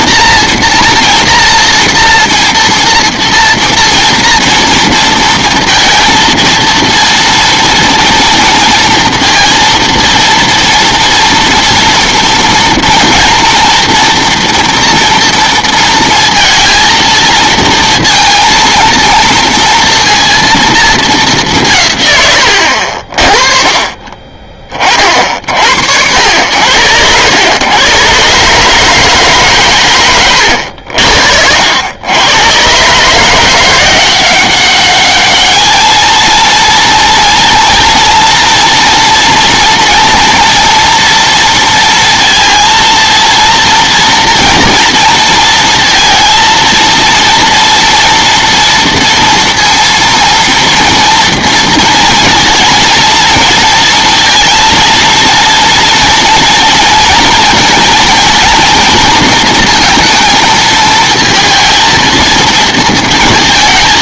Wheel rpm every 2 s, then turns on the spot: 230, 230, 230, 230, 230, 240, 230, 240, 230, 230, 220, 70, 30, 90, 150, 70, 130, 200, 230, 230, 230, 230, 230, 230, 230, 230, 230, 230, 230, 230, 220, 230.
none